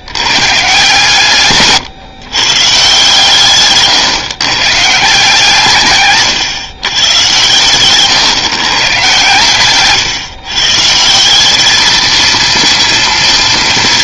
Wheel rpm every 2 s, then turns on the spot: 130, 140, 140, 140, 140, 140, 230.
none